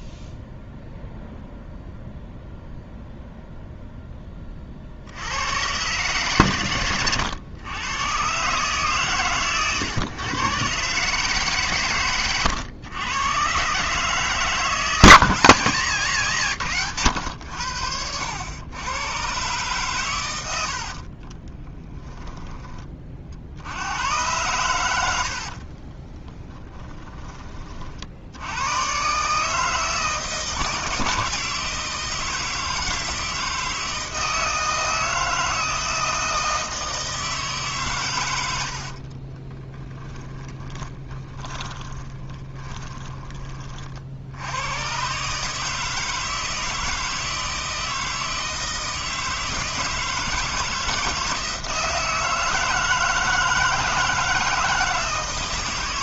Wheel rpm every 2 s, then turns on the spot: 0, 0, 60, 110, 140, 130, 110, 160, 120, 100, 60, 20, 100, 30, 110, 160, 160, 160, 160, 70, 20, 20, 120, 160, 160, 160, 160, 160.
20-22 26-28 38-44